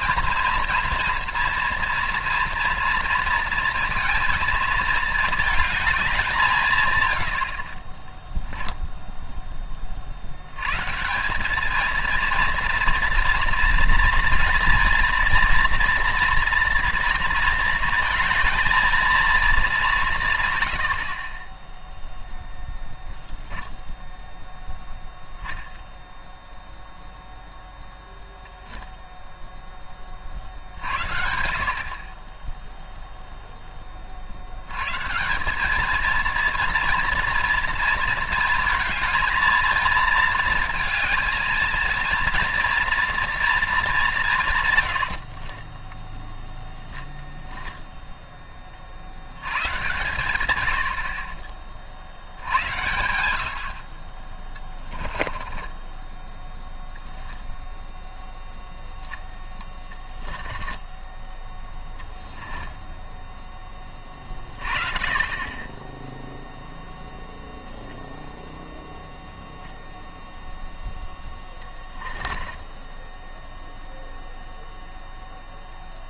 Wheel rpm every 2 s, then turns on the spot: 230, 230, 220, 120, 10, 160, 230, 230, 240, 230, 60, 10, 0, 0, 0, 60, 0, 130, 230, 220, 230, 230, 90, 0, 60, 60, 80, 10, 0, 0, 10, 0, 30, 0, 0, 10, 10, 0.
20-24 54-56 60-62 70-74